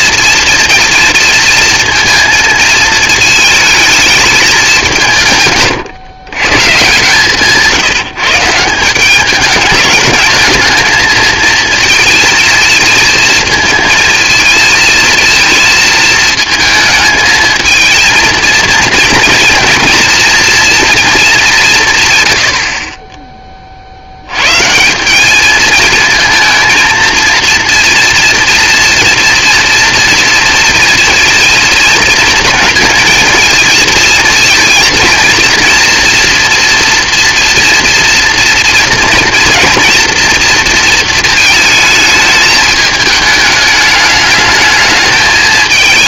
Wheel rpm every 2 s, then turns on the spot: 230, 220, 170, 140, 200, 230, 230, 230, 220, 230, 210, 20, 180, 230, 240, 230, 220, 230, 230, 230, 230, 210, 210.
6-8